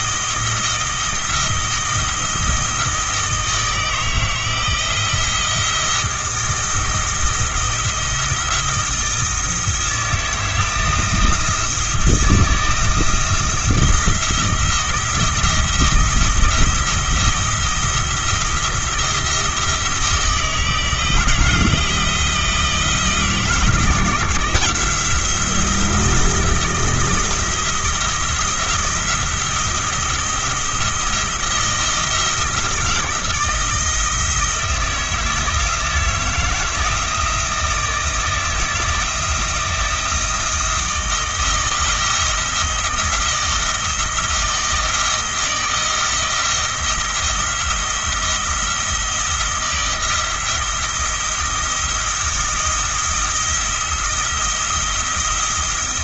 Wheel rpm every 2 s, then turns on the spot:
170, 170, 160, 170, 170, 160, 160, 170, 170, 170, 160, 160, 170, 170, 170, 170, 170, 160, 160, 160, 160, 170, 160, 170, 170, 170, 170, 170.
none